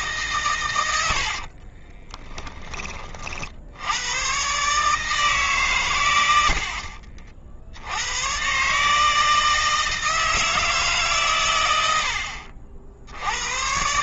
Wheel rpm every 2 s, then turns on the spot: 80, 30, 150, 50, 150, 140, 60.
0-2 6-8